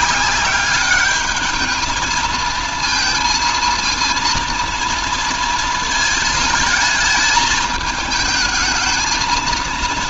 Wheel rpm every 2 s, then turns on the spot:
200, 230, 230, 220, 220.
none